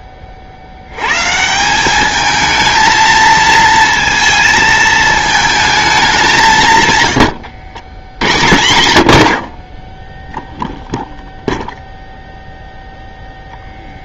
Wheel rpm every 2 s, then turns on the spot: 40, 220, 220, 170, 100, 0, 0.
none